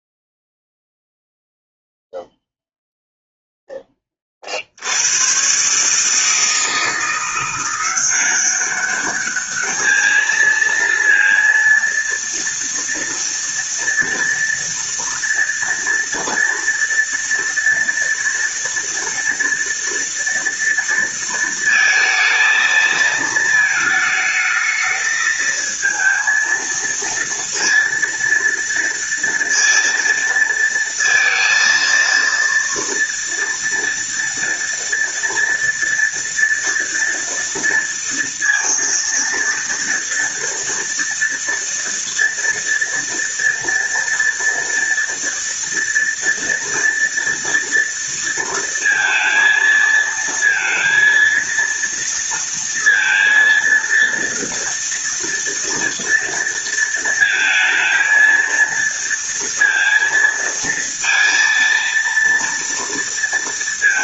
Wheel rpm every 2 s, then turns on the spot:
0, 0, 80, 160, 200, 230, 230, 230, 230, 230, 230, 220, 220, 230, 230, 230, 230, 240, 230, 230, 230, 230, 230, 230, 230, 230, 230, 230, 230, 230, 230, 230.
none